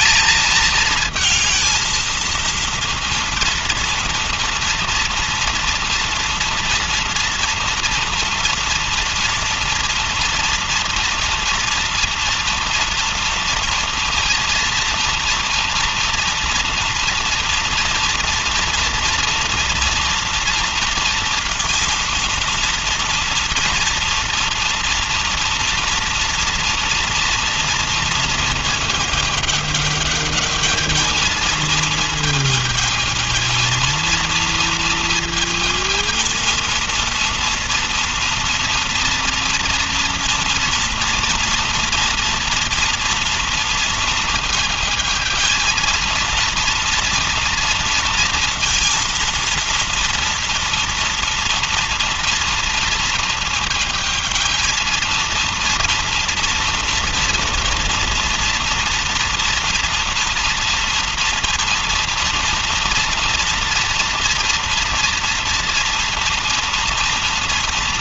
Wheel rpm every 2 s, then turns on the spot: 220, 230, 230, 230, 230, 230, 230, 230, 230, 230, 230, 230, 230, 230, 230, 210, 220, 230, 230, 240, 230, 240, 230, 230, 230, 230, 230, 220, 230, 230, 230, 230, 230, 230.
none